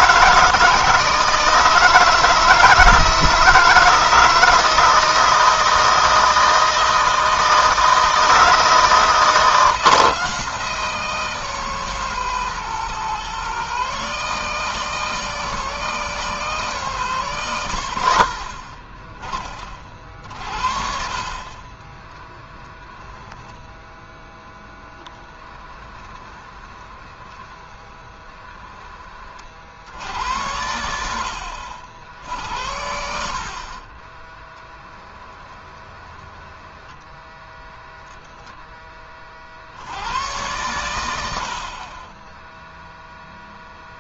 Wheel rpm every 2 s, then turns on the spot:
160, 160, 170, 160, 160, 160, 160, 160, 160, 60, 40, 20, 0, 20, 20, 90, 70, 20, 10, 10, 100, 0.
22-24 26-28 34-38